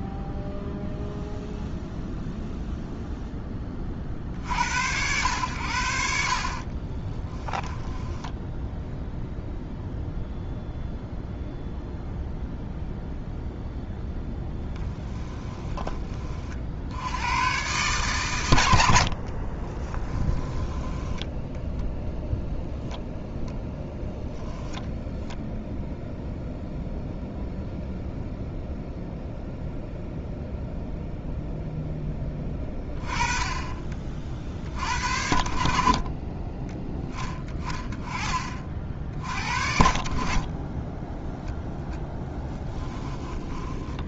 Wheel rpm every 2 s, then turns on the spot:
0, 0, 70, 40, 0, 0, 0, 10, 60, 100, 20, 0, 0, 0, 0, 0, 20, 50, 20, 40, 30, 10.
6-8 14-16 20-22 42-44